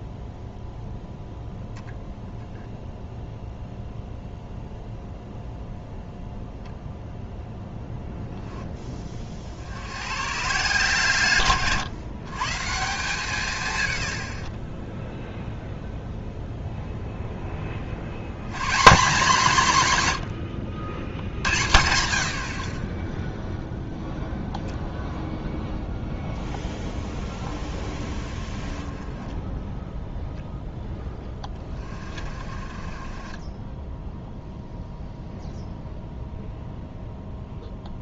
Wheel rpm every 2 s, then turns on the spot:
0, 0, 0, 0, 20, 140, 170, 20, 0, 170, 100, 50, 0, 10, 10, 10, 30, 0, 0.
30-34